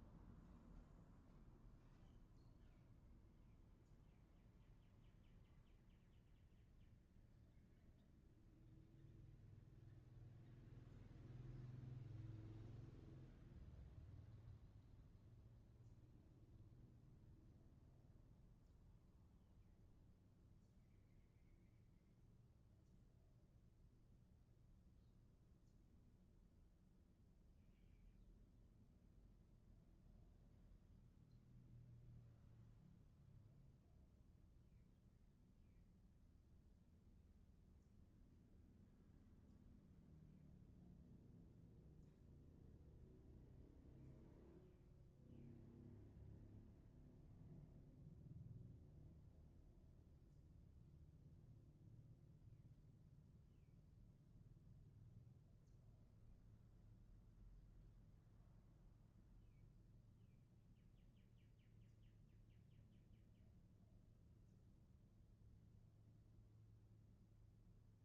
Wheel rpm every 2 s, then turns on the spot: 0, 0, 0, 0, 0, 0, 0, 0, 0, 0, 0, 0, 0, 0, 0, 0, 0, 0, 0, 0, 0, 0, 0, 0, 0, 0, 0, 0, 0, 0, 0, 0, 0, 0.
none